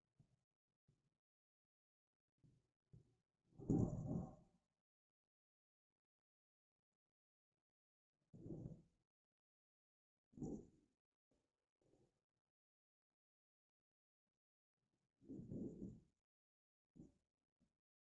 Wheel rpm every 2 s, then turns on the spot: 0, 0, 0, 0, 0, 0, 0, 0, 0.
none